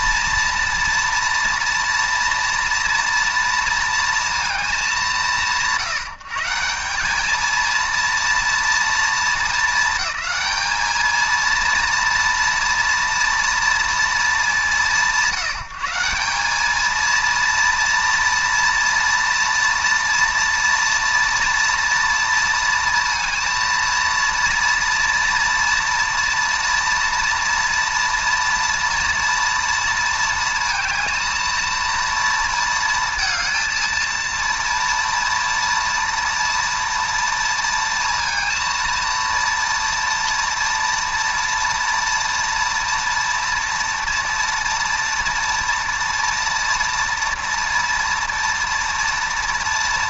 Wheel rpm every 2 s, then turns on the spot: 240, 230, 190, 180, 230, 220, 230, 180, 220, 240, 240, 230, 230, 240, 230, 230, 230, 230, 230, 230, 230, 230, 230, 230, 230.
none